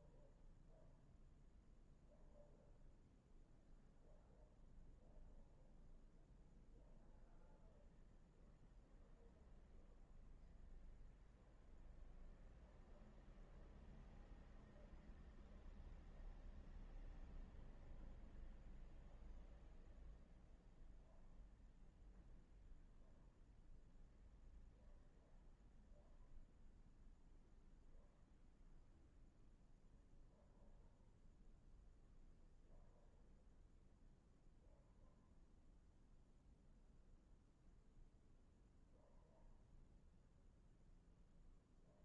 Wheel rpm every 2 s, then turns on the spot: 0, 0, 0, 0, 0, 0, 0, 0, 0, 0, 0, 0, 0, 0, 0, 0, 0, 0, 0, 0, 0.
none